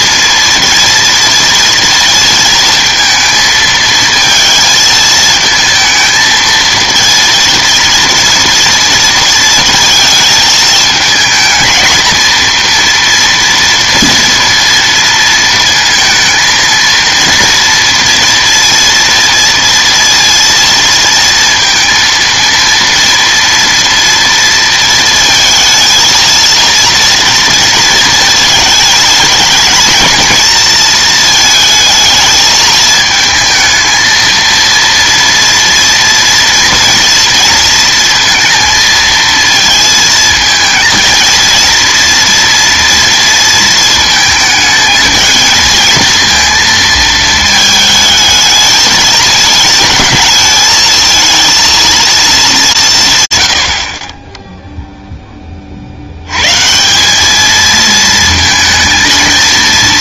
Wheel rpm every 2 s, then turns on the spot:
230, 230, 220, 220, 230, 220, 230, 230, 230, 230, 230, 230, 230, 230, 220, 230, 220, 230, 230, 230, 230, 230, 220, 230, 220, 220, 190, 0, 150, 230.
none